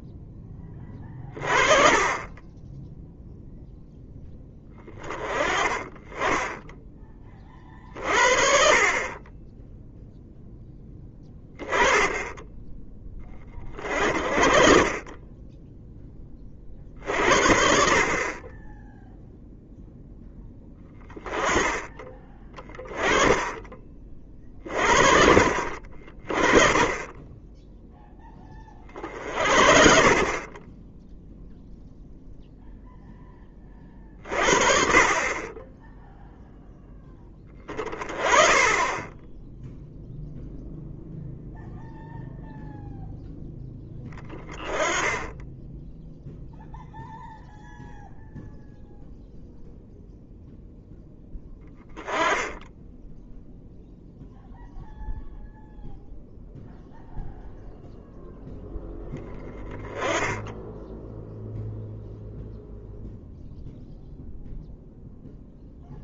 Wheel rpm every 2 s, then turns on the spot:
20, 10, 10, 20, 40, 10, 10, 30, 50, 10, 10, 20, 50, 20, 30, 10, 0, 40, 10, 20, 0, 0, 20, 0, 0, 0, 10, 0, 0, 0, 0, 0, 0.
22-24